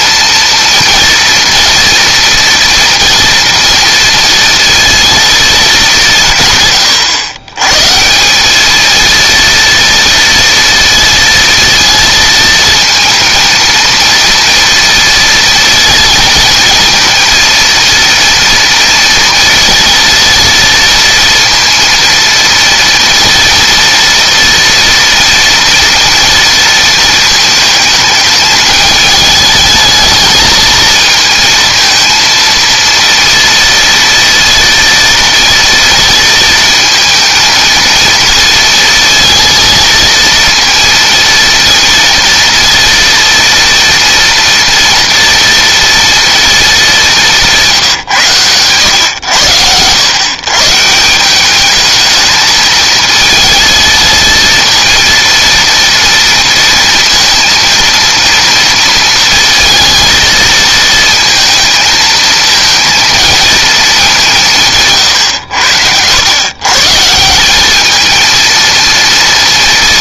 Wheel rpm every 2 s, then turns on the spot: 230, 230, 230, 130, 210, 230, 230, 230, 230, 240, 230, 230, 230, 230, 210, 220, 230, 230, 220, 230, 230, 230, 230, 210, 110, 140, 220, 230, 230, 230, 230, 230, 160, 130, 230.
none